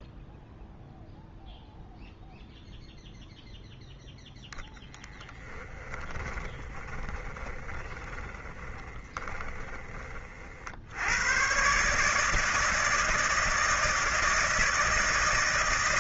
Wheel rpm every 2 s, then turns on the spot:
0, 0, 10, 20, 20, 90, 160, 160.
4-10